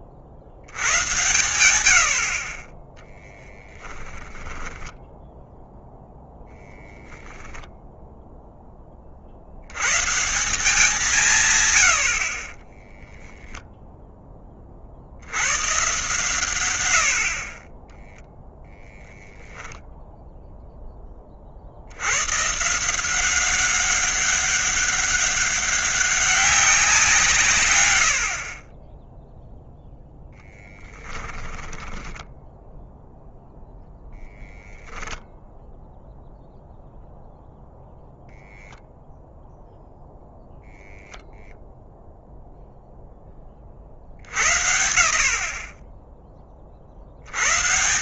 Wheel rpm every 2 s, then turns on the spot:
100, 20, 10, 0, 20, 180, 10, 50, 90, 0, 10, 170, 200, 180, 10, 20, 0, 0, 0, 0, 0, 0, 70, 50.
4-6 12-14 30-32